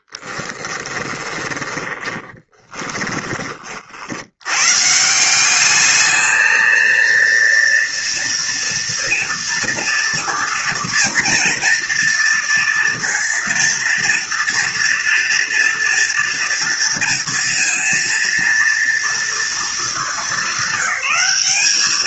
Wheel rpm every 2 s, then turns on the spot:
20, 20, 180, 230, 230, 230, 230, 230, 230, 230, 200.
0-2